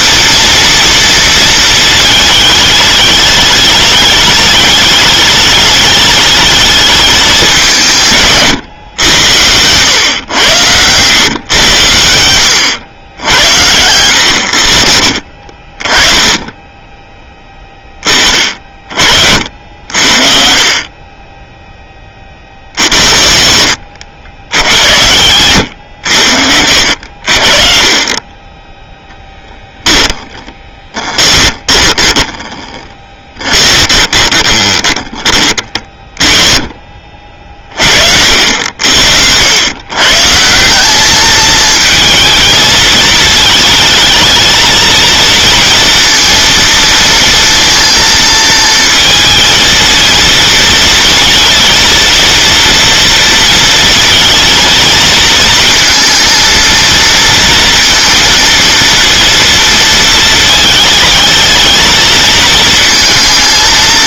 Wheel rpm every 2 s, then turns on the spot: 230, 210, 220, 210, 130, 100, 90, 70, 20, 40, 40, 60, 90, 80, 10, 20, 20, 20, 30, 70, 180, 220, 230, 230, 230, 230, 230, 220, 230, 230, 220, 220.
8-10 30-36